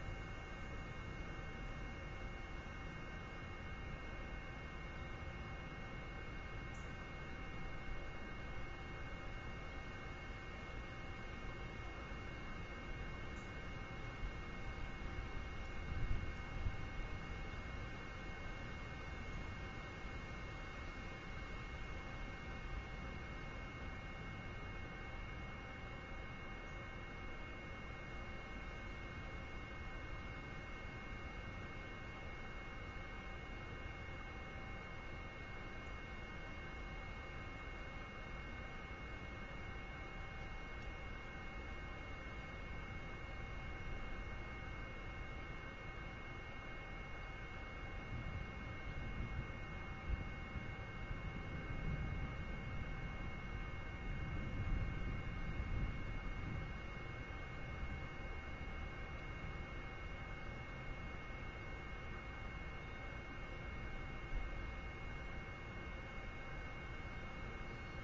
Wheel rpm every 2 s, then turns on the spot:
0, 0, 0, 0, 0, 0, 0, 0, 0, 0, 0, 0, 0, 0, 0, 0, 0, 0, 0, 0, 0, 0, 0, 0, 0, 0, 0, 0, 0, 0, 0, 0, 0, 0.
none